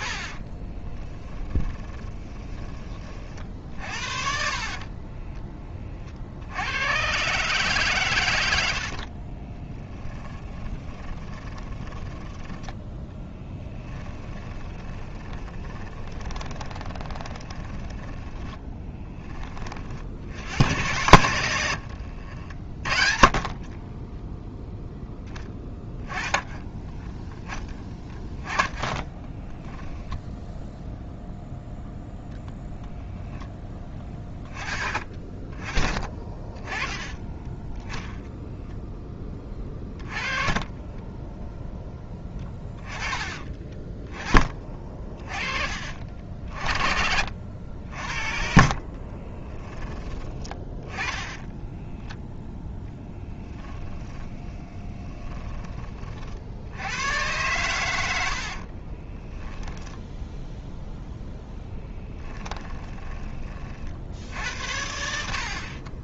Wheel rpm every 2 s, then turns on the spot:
20, 40, 30, 100, 70, 20, 10, 20, 20, 10, 110, 40, 0, 10, 20, 0, 0, 20, 20, 10, 20, 20, 30, 60, 40, 10, 10, 20, 90, 30, 0, 20, 70.
0-6 8-12 14-18 28-30 40-42 46-50 54-56 58-60 62-64